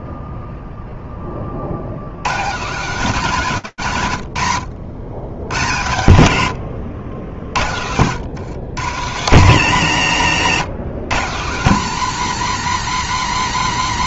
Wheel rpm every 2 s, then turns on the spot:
0, 200, 100, 60, 140, 150, 190.
none